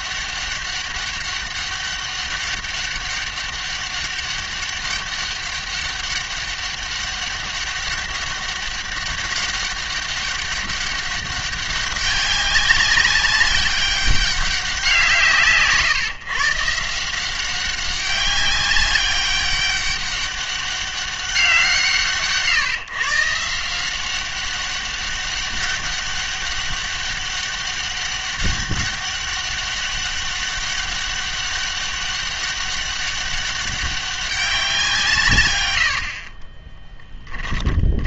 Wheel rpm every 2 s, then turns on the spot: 200, 200, 200, 200, 200, 200, 190, 180, 150, 200, 200, 140, 200, 200, 200, 200, 200, 180, 20.
36-38